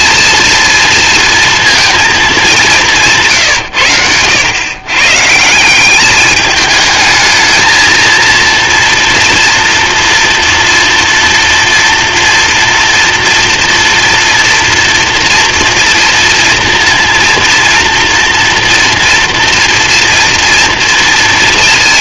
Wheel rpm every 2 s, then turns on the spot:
230, 180, 110, 210, 230, 240, 240, 240, 230, 230, 230.
none